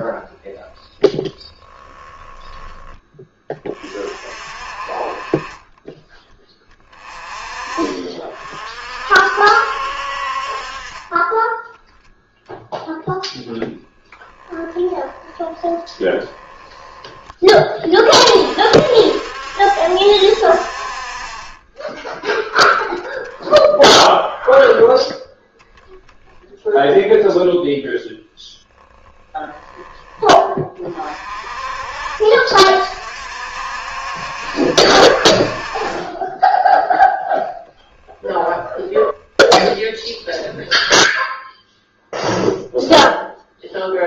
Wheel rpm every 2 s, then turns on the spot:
10, 10, 30, 20, 50, 40, 0, 10, 10, 50, 60, 10, 10, 0, 0, 30, 60, 60, 10, 10, 10, 0.
10-12 14-16 38-40